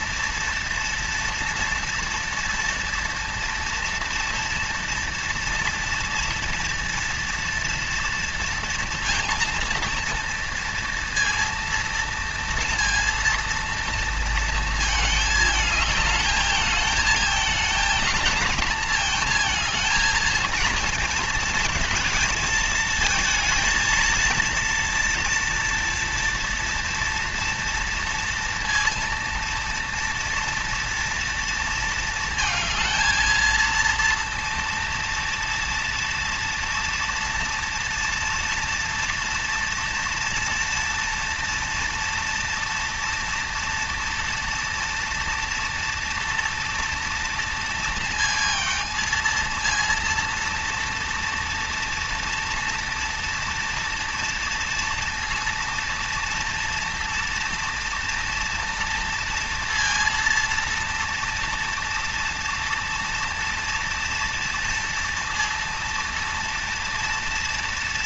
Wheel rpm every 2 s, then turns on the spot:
230, 230, 230, 230, 230, 230, 230, 230, 220, 220, 220, 230, 230, 230, 230, 230, 220, 230, 230, 230, 230, 240, 230, 230, 230, 230, 230, 230, 230, 230, 230, 230, 230, 230.
none